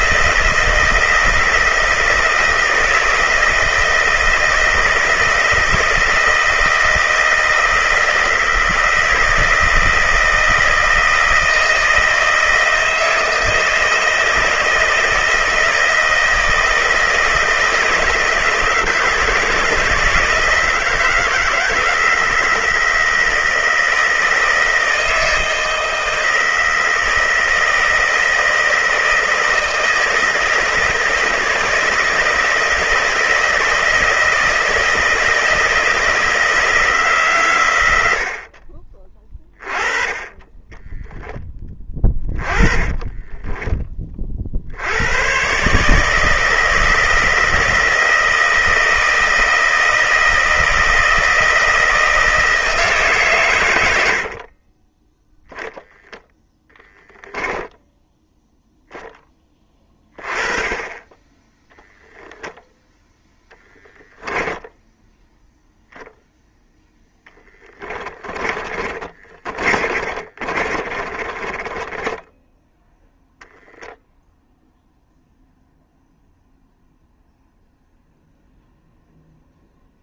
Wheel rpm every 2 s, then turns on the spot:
160, 160, 160, 160, 160, 160, 160, 160, 160, 160, 160, 160, 160, 160, 160, 160, 160, 160, 160, 30, 10, 30, 80, 160, 160, 160, 160, 30, 10, 0, 20, 0, 0, 0, 30, 40, 0, 0, 0, 0.
40-44 54-56 68-72